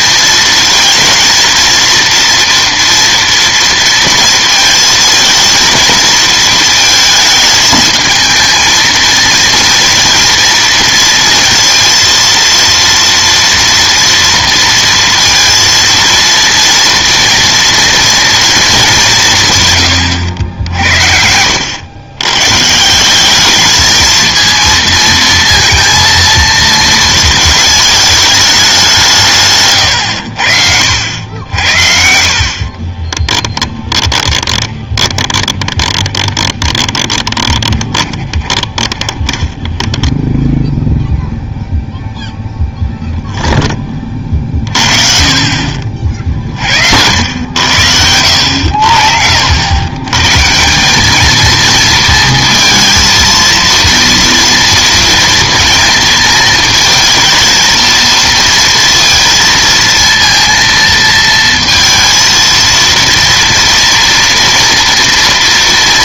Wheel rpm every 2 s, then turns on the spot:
230, 230, 220, 220, 220, 230, 230, 230, 230, 200, 60, 150, 230, 230, 200, 70, 40, 20, 20, 20, 0, 0, 40, 60, 80, 160, 230, 230, 220, 230, 230, 230, 230.
32-40